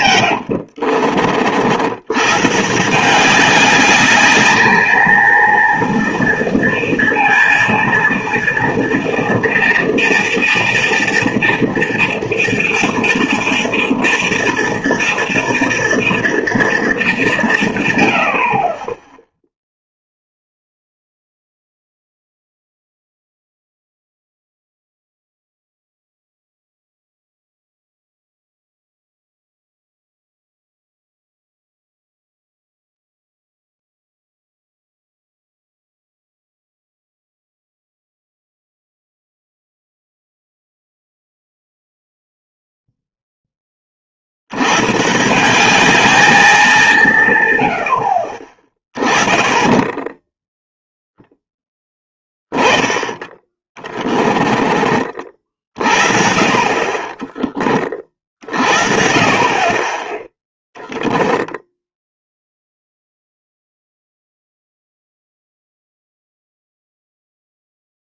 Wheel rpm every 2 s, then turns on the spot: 90, 150, 210, 230, 230, 230, 230, 230, 230, 50, 0, 0, 0, 0, 0, 0, 0, 0, 0, 0, 0, 0, 100, 200, 30, 0, 10, 30, 50, 50, 0, 0, 0, 0.
0-2 54-56